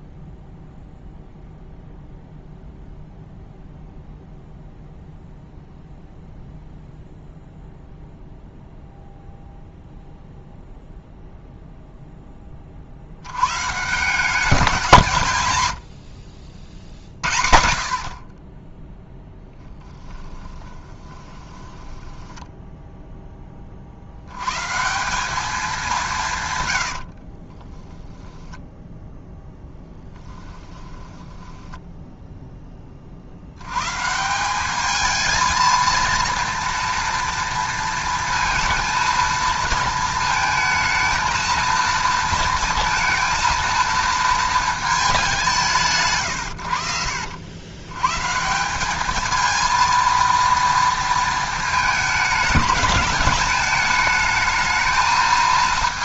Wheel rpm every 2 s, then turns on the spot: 0, 0, 0, 0, 0, 0, 60, 180, 70, 10, 20, 0, 160, 90, 10, 10, 30, 210, 230, 230, 220, 230, 220, 90, 190, 230, 200, 220.
18-22 26-32